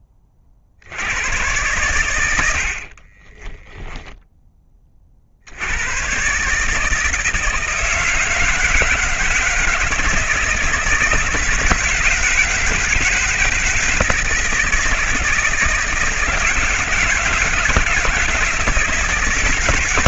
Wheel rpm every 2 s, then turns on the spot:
50, 90, 20, 150, 160, 160, 160, 160, 170, 160.
2-4